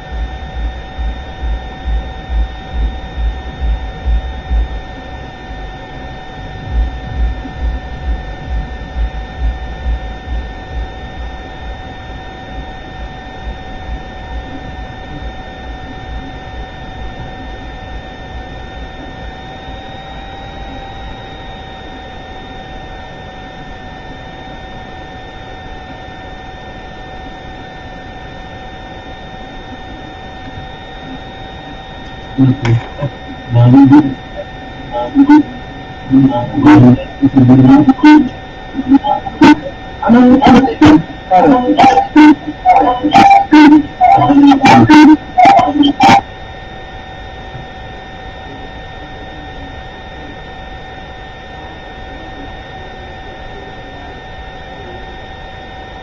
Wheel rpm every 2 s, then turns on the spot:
0, 0, 0, 0, 0, 0, 0, 0, 0, 0, 0, 0, 0, 0, 0, 0, 0, 0, 0, 0, 0, 0, 0, 0, 0, 0, 0, 0.
none